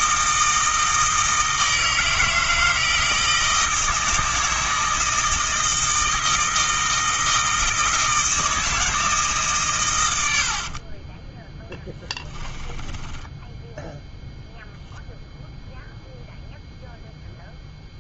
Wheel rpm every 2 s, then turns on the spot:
160, 160, 160, 160, 160, 40, 10, 0, 0.
10-14